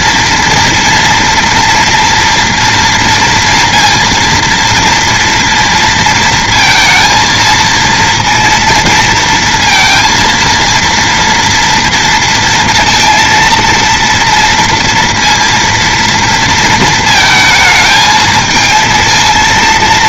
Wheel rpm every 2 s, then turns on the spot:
230, 240, 230, 230, 230, 230, 230, 230, 230, 220.
none